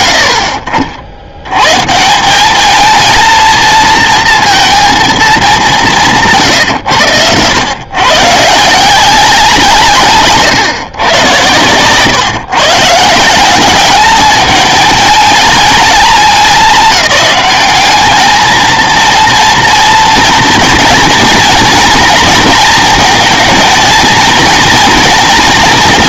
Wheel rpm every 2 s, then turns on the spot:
80, 220, 220, 110, 160, 140, 150, 220, 210, 230, 240, 220, 230.
none